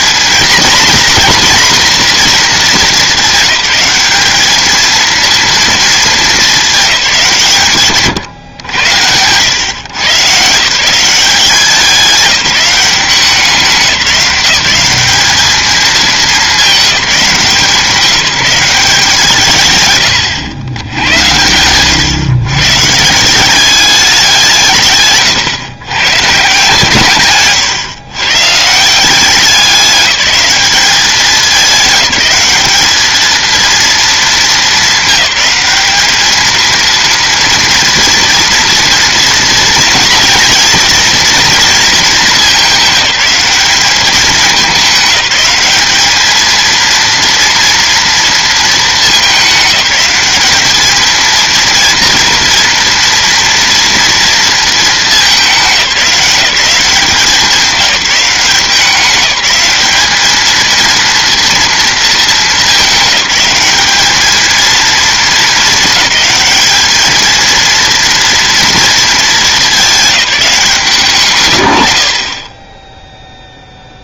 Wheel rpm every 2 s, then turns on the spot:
230, 220, 220, 200, 100, 150, 180, 190, 210, 190, 90, 140, 160, 150, 160, 210, 210, 210, 230, 230, 230, 210, 210, 230, 220, 220, 230, 220, 190, 190, 220, 200, 230, 220, 220, 160, 10.
none